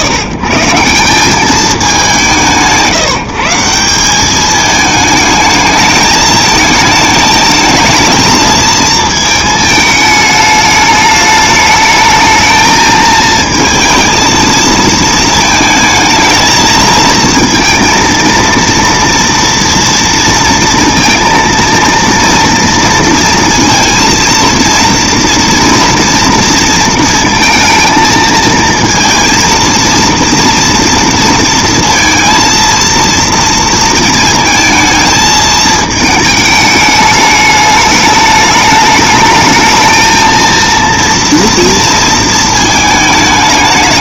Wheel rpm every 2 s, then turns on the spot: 140, 170, 210, 220, 220, 210, 220, 220, 220, 230, 230, 230, 230, 230, 220, 230, 230, 220, 210, 210, 230, 220.
none